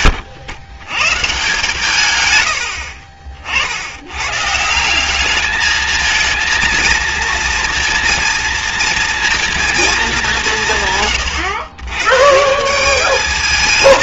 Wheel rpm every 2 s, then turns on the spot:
140, 60, 200, 230, 230, 130, 210.
none